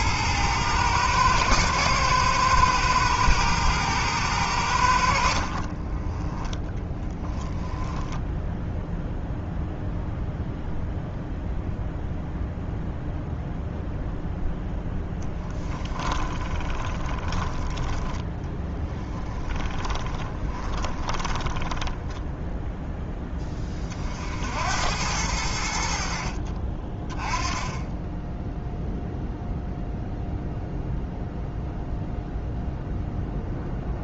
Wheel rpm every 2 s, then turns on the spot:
110, 110, 70, 10, 0, 0, 0, 10, 20, 20, 20, 10, 90, 20, 0, 0, 0.
6-8 14-22